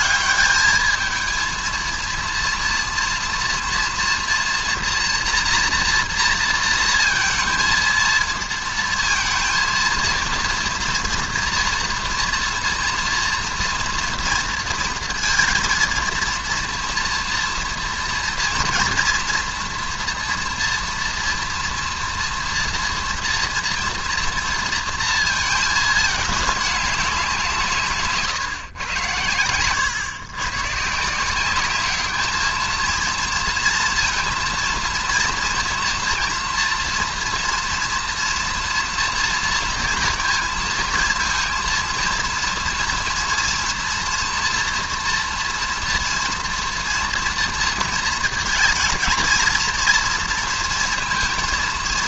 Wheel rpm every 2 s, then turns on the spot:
210, 230, 240, 230, 230, 230, 230, 230, 230, 230, 230, 230, 230, 210, 130, 130, 220, 230, 230, 230, 230, 230, 240, 230, 230, 230.
none